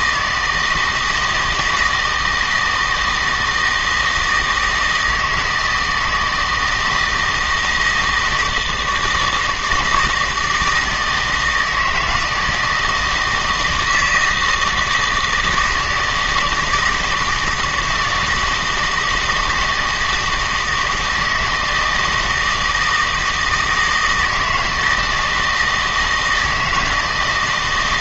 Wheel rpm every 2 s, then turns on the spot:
160, 160, 160, 160, 160, 160, 160, 160, 160, 160, 160, 160, 160, 160.
none